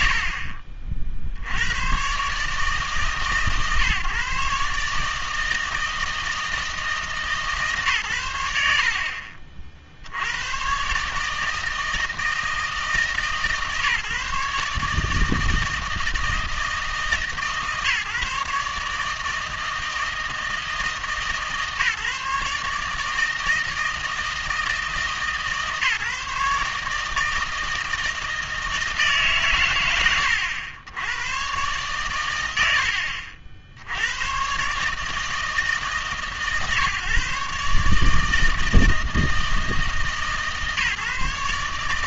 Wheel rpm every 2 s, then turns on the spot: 70, 150, 140, 160, 80, 120, 160, 150, 160, 150, 150, 150, 160, 150, 160, 90, 90, 140, 140, 160, 140.
none